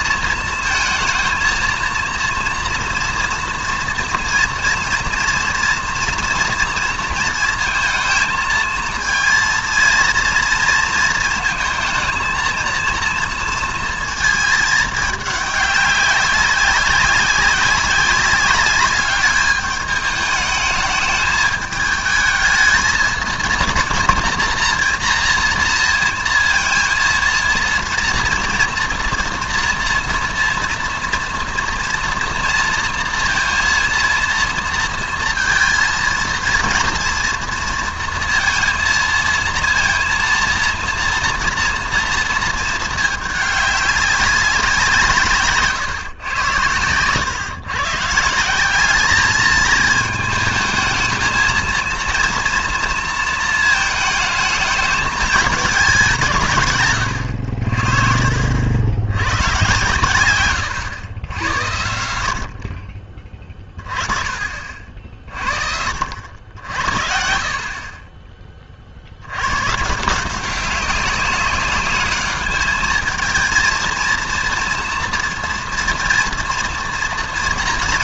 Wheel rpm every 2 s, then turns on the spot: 230, 230, 230, 230, 230, 230, 230, 220, 190, 200, 210, 220, 230, 230, 230, 230, 230, 230, 230, 230, 230, 220, 180, 110, 190, 220, 230, 220, 130, 60, 110, 50, 50, 70, 30, 180, 210, 230, 230.
none